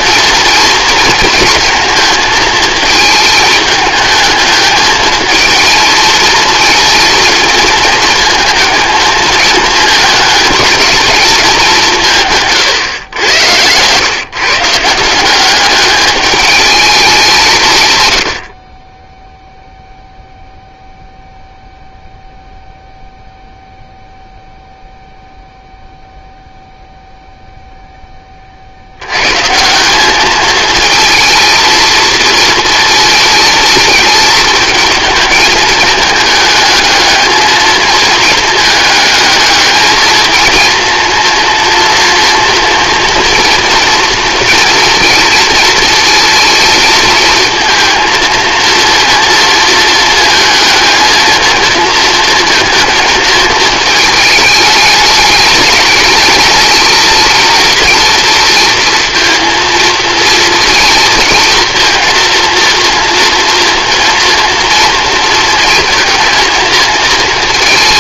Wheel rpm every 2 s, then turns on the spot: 230, 220, 220, 220, 230, 210, 140, 150, 210, 50, 0, 0, 0, 0, 40, 220, 220, 220, 220, 220, 230, 230, 230, 230, 230, 230, 230, 210, 220, 230, 230, 230, 240, 230.
none